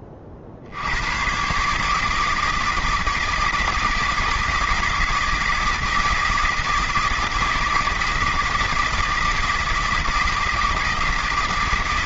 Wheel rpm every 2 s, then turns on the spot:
90, 160, 160, 160, 160, 160.
none